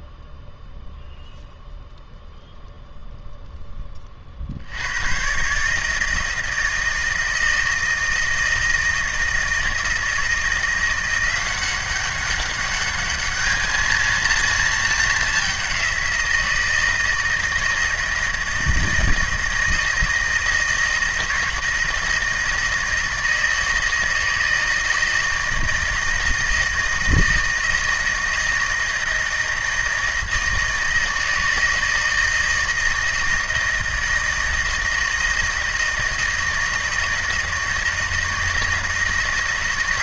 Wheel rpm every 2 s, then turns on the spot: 0, 0, 70, 160, 160, 170, 200, 220, 170, 160, 170, 160, 160, 160, 160, 160, 160, 160, 160, 160.
none